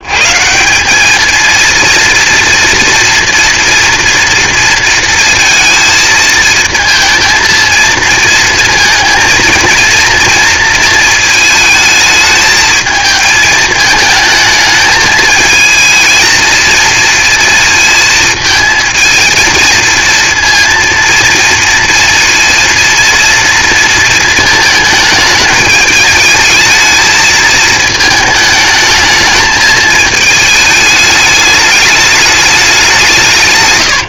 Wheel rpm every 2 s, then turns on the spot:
190, 230, 230, 220, 230, 230, 220, 220, 230, 230, 230, 230, 220, 210, 210, 220, 200.
none